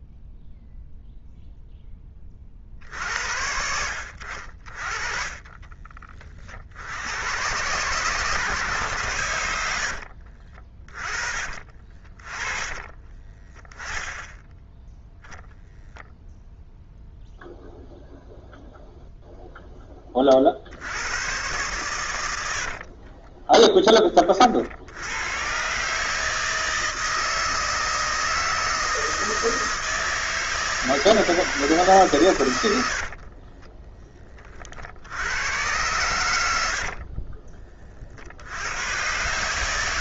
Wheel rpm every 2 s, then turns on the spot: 0, 60, 50, 60, 130, 40, 20, 0, 0, 0, 50, 70, 60, 160, 160, 160, 100, 50, 80, 90.
12-14 22-24 32-34 36-38